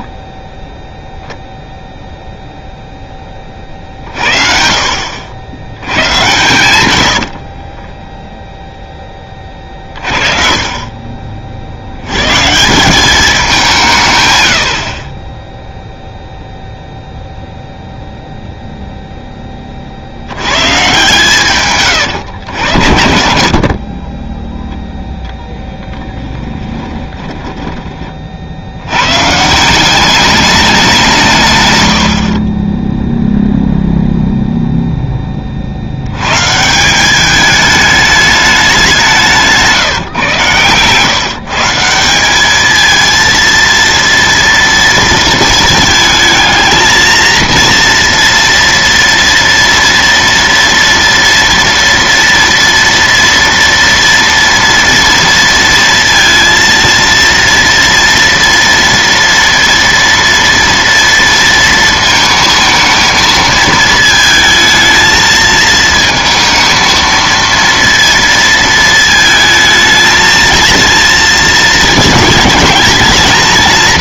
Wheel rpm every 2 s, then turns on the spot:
0, 0, 60, 100, 10, 30, 150, 80, 0, 0, 120, 90, 0, 20, 80, 200, 20, 0, 160, 200, 120, 210, 230, 220, 230, 230, 230, 240, 230, 230, 230, 220, 220, 230, 230, 220, 220.
6-8 26-28